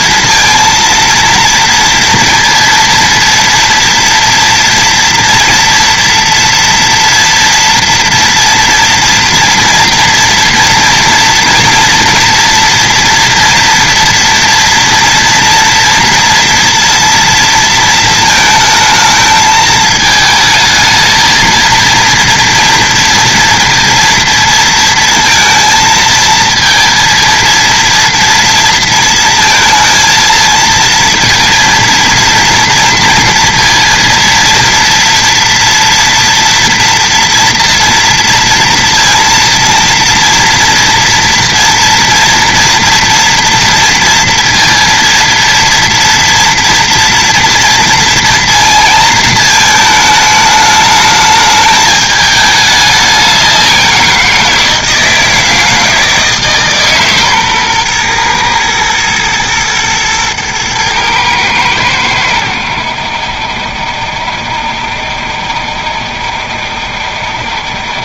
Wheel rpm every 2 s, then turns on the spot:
230, 230, 230, 230, 240, 230, 230, 230, 230, 220, 220, 230, 230, 230, 230, 230, 230, 230, 230, 230, 230, 230, 230, 230, 230, 210, 210, 170, 150, 120, 110, 80, 70, 70.
none